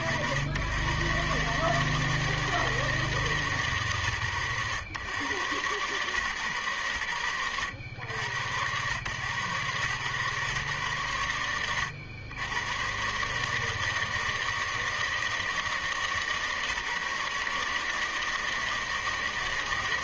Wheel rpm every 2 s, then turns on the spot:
60, 160, 120, 130, 100, 110, 100, 160, 150, 150.
none